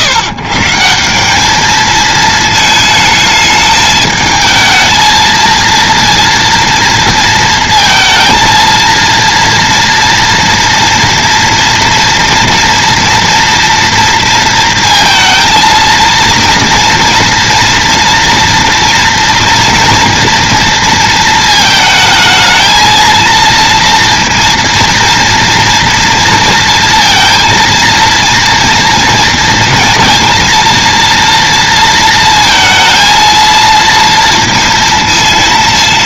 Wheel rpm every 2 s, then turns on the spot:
140, 220, 220, 230, 230, 230, 240, 230, 230, 240, 230, 230, 230, 230, 230, 230, 230, 230.
none